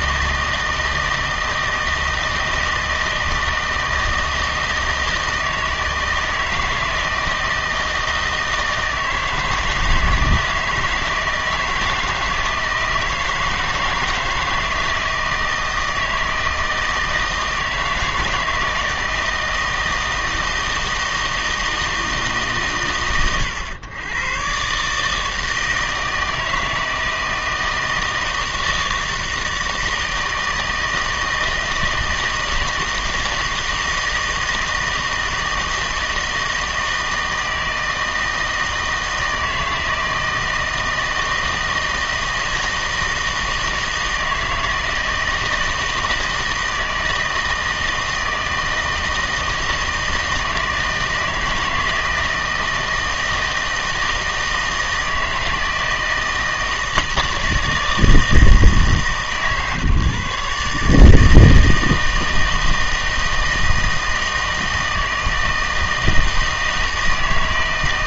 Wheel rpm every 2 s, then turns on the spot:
160, 160, 160, 160, 160, 160, 160, 160, 160, 160, 160, 120, 140, 160, 160, 160, 160, 160, 160, 160, 160, 160, 160, 160, 160, 160, 160, 160, 160, 160, 150, 160, 160, 160.
none